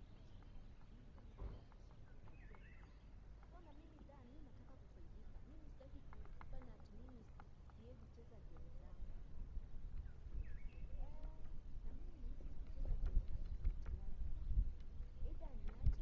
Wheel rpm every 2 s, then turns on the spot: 0, 0, 0, 0, 0, 0, 0, 0.
none